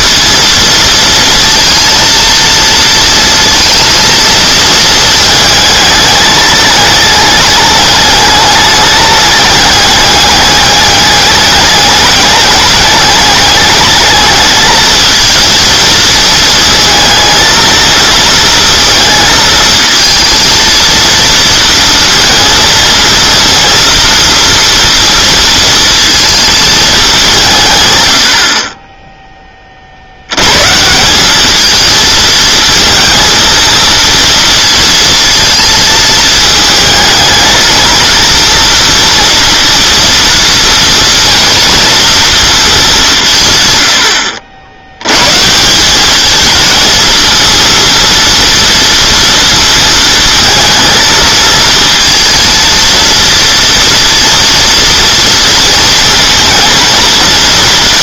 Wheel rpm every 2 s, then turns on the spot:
230, 230, 230, 210, 210, 210, 210, 220, 220, 230, 230, 230, 230, 210, 30, 150, 220, 230, 220, 230, 230, 200, 80, 230, 230, 230, 230, 230, 220.
none